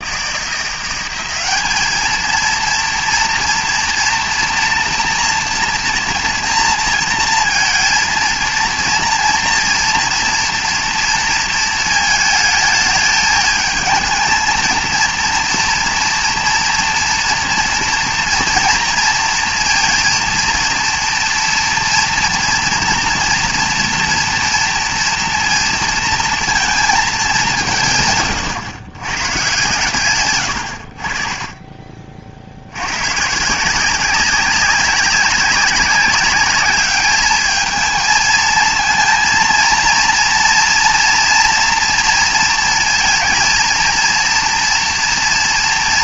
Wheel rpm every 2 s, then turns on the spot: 180, 230, 240, 230, 230, 240, 220, 230, 230, 230, 230, 230, 230, 230, 110, 90, 80, 190, 210, 230, 230, 230, 230.
none